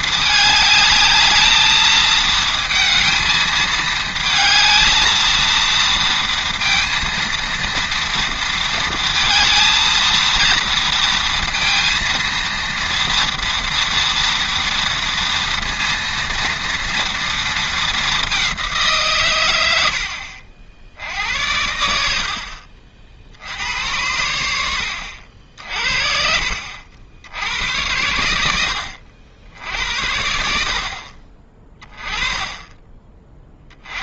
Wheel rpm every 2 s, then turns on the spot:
210, 220, 220, 230, 230, 230, 230, 230, 230, 170, 70, 50, 70, 70, 90, 50, 20.
none